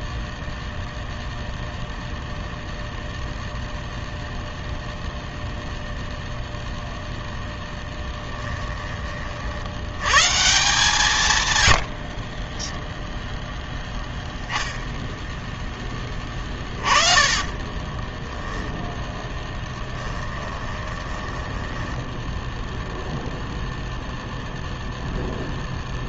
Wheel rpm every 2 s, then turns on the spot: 0, 0, 0, 0, 10, 150, 10, 10, 30, 10, 20, 0, 0.
12-14 16-18 20-22